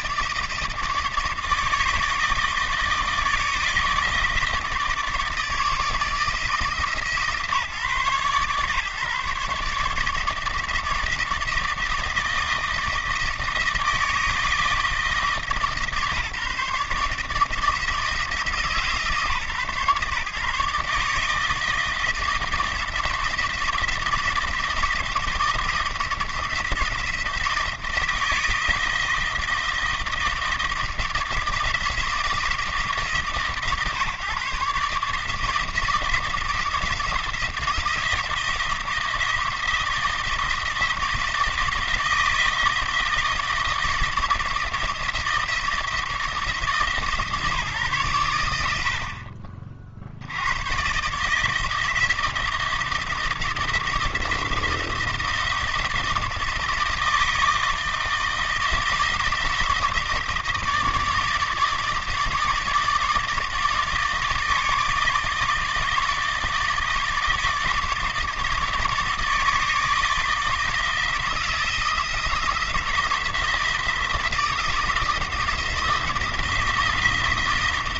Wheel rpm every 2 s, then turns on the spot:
160, 160, 150, 160, 140, 160, 160, 160, 150, 160, 150, 160, 160, 170, 160, 160, 150, 140, 170, 160, 170, 160, 160, 150, 70, 110, 160, 160, 160, 160, 160, 160, 160, 160, 150, 160, 170, 170, 160.
none